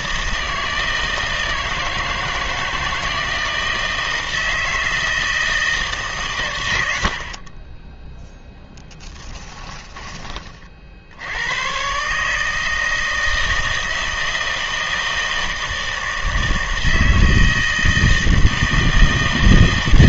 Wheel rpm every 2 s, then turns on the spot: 160, 160, 160, 110, 10, 40, 160, 160, 160, 160.
8-10